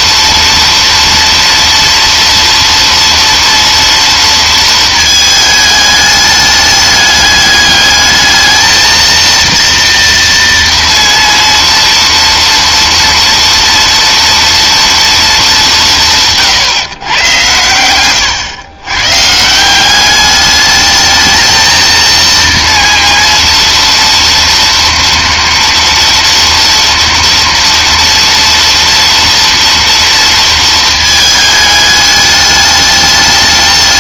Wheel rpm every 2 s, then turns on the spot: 230, 230, 230, 210, 220, 230, 230, 230, 140, 110, 210, 230, 230, 240, 240, 230, 210.
none